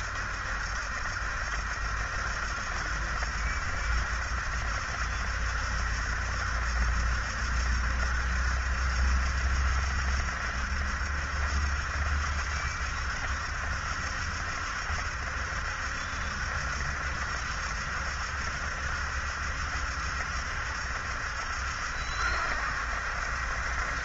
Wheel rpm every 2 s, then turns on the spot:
70, 70, 70, 70, 70, 70, 70, 70, 70, 70, 70, 70.
none